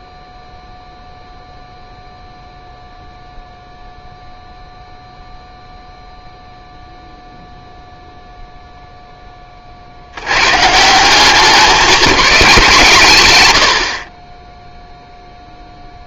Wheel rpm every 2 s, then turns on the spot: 0, 0, 0, 0, 0, 150, 160, 0.
none